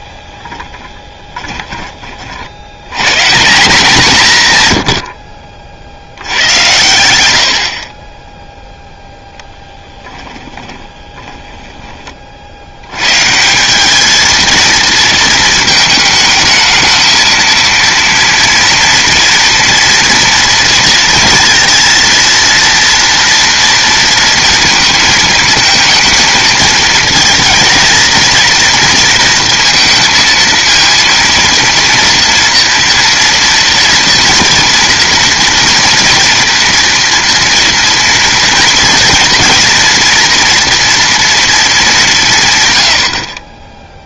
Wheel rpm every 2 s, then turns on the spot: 20, 140, 70, 90, 0, 10, 100, 230, 220, 230, 230, 230, 230, 220, 230, 230, 230, 230, 240, 230, 230, 100.
0-2 10-12